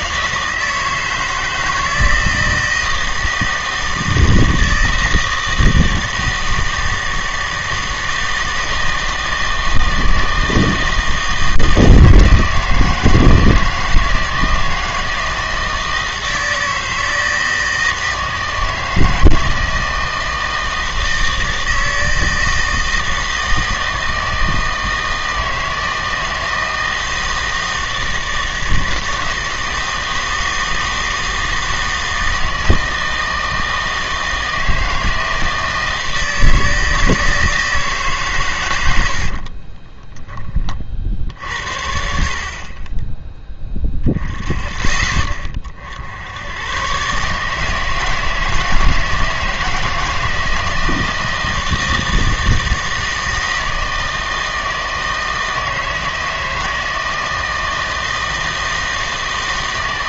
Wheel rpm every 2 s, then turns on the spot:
160, 160, 160, 160, 160, 160, 160, 160, 160, 160, 160, 160, 160, 160, 160, 160, 160, 160, 160, 110, 30, 40, 30, 110, 160, 160, 160, 160, 160, 160.
none